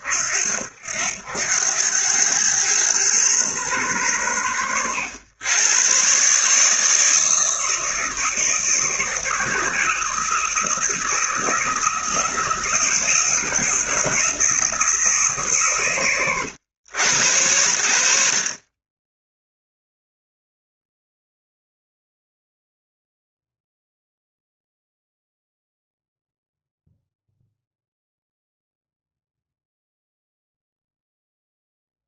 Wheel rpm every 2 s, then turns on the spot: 80, 110, 90, 150, 160, 170, 160, 170, 100, 20, 0, 0, 0, 0, 0, 0.
none